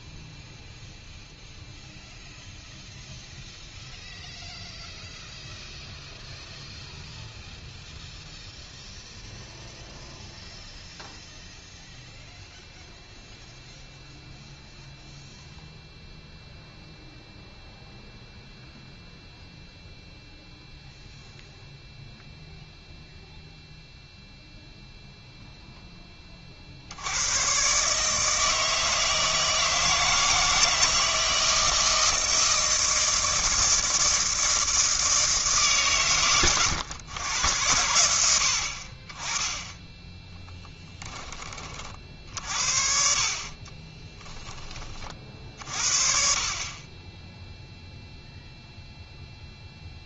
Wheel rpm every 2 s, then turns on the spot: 0, 0, 0, 0, 0, 0, 0, 0, 0, 0, 0, 0, 0, 60, 160, 170, 160, 160, 110, 70, 10, 50, 20, 30, 0.
none